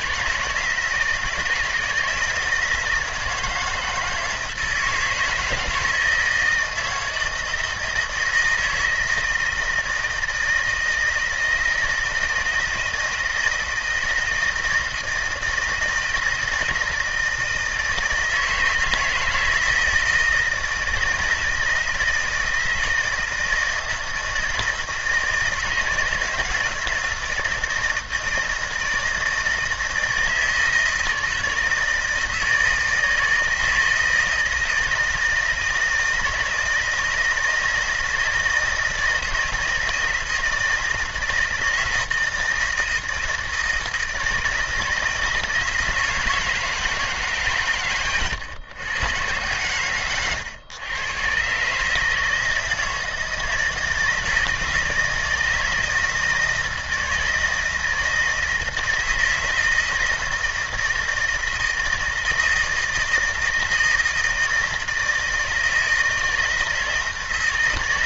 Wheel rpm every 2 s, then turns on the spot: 160, 160, 160, 160, 160, 160, 170, 160, 160, 160, 160, 160, 160, 160, 170, 160, 160, 160, 160, 160, 160, 160, 160, 160, 120, 110, 160, 160, 160, 160, 170, 160, 160, 160.
none